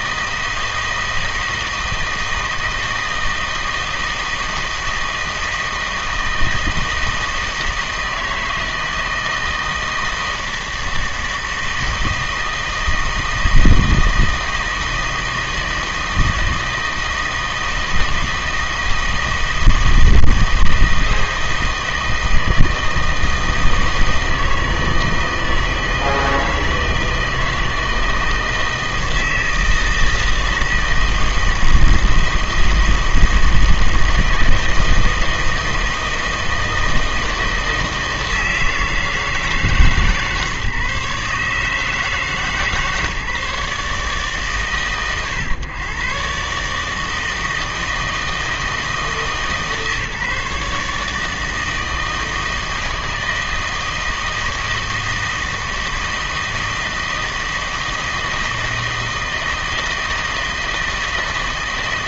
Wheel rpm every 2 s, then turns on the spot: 160, 160, 160, 160, 160, 160, 160, 160, 160, 160, 160, 160, 160, 160, 160, 160, 160, 160, 160, 160, 140, 150, 130, 150, 160, 150, 160, 160, 160, 160, 160.
none